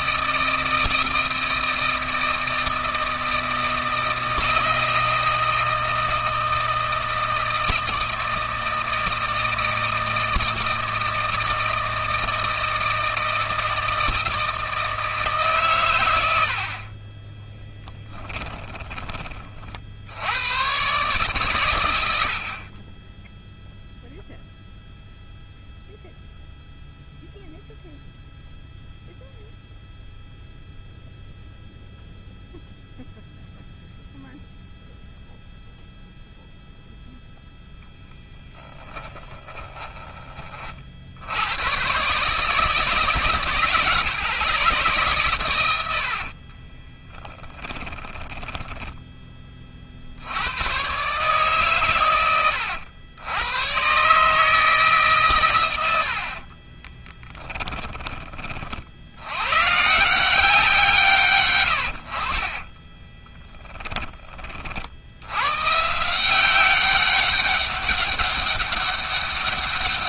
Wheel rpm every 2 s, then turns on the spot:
160, 160, 160, 160, 160, 160, 160, 160, 30, 20, 130, 20, 0, 0, 0, 0, 0, 0, 0, 20, 70, 150, 120, 20, 10, 130, 90, 150, 20, 80, 150, 20, 90, 190, 200.
16-18 38-40 46-48 56-58 62-64